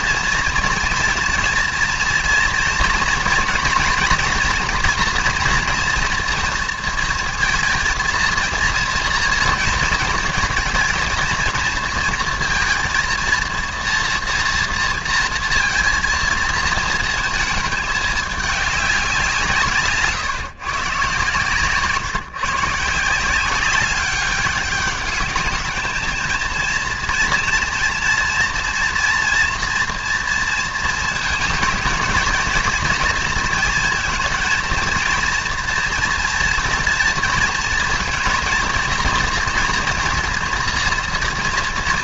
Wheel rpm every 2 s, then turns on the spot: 230, 230, 240, 230, 230, 240, 230, 230, 230, 200, 130, 160, 200, 230, 240, 230, 230, 230, 230, 230, 230.
none